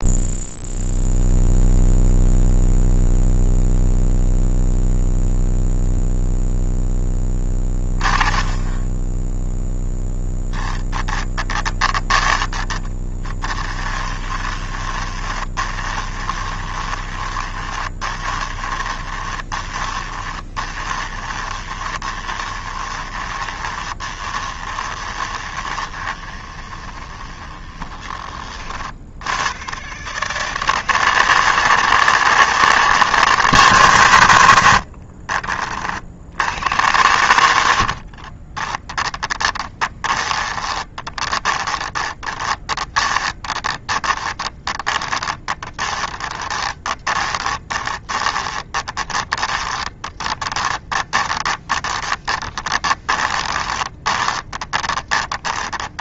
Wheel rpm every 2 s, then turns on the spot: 0, 0, 0, 0, 10, 10, 10, 20, 20, 20, 20, 20, 20, 20, 70, 160, 160, 60, 90, 20, 20, 20, 20, 20, 10, 20, 20, 20.
14-28 34-36 38-56